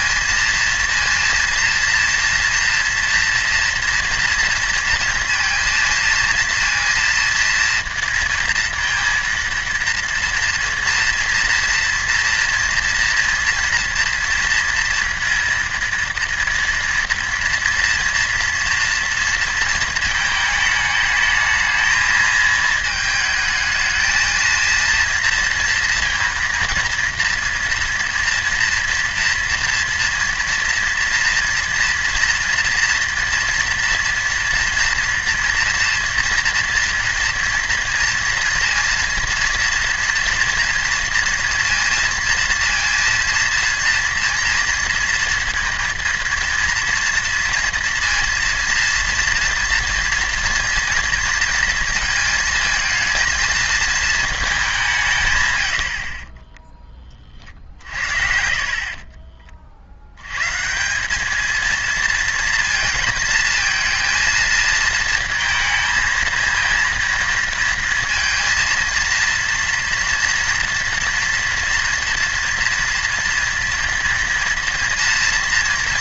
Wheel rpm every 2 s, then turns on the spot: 230, 230, 230, 230, 230, 230, 230, 230, 230, 230, 220, 220, 230, 230, 230, 230, 230, 240, 230, 230, 240, 230, 230, 230, 230, 240, 220, 200, 10, 50, 130, 230, 220, 230, 230, 230, 240, 230.
56-58